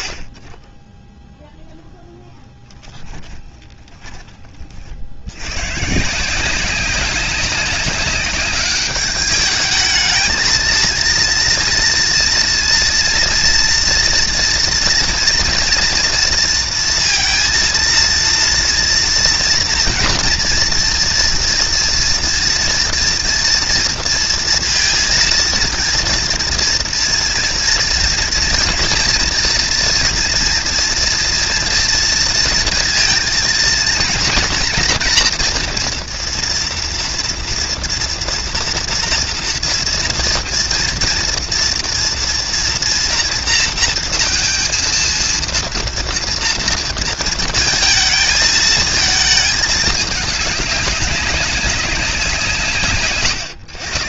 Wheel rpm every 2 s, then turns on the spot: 30, 10, 70, 190, 200, 230, 230, 230, 230, 240, 230, 230, 230, 230, 240, 230, 230, 240, 230, 240, 230, 230, 230, 230, 220, 190, 140.
2-4